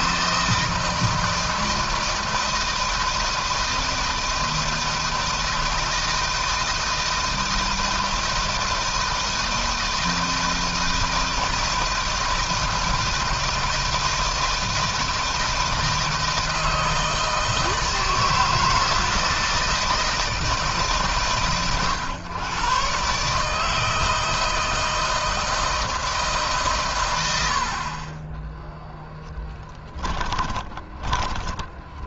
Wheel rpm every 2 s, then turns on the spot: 160, 160, 160, 160, 160, 160, 160, 160, 160, 160, 140, 130, 160, 120, 10, 20.
28-32